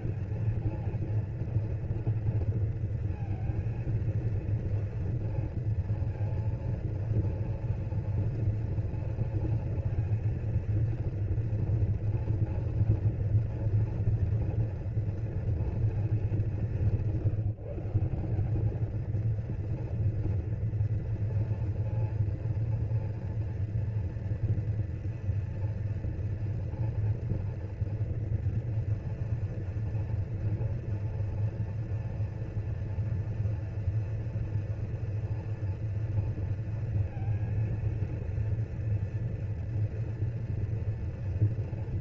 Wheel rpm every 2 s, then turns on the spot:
230, 230, 230, 230, 230, 230, 230, 230, 180, 200, 230, 230, 240, 230, 230, 230, 230, 230, 230, 230, 230.
none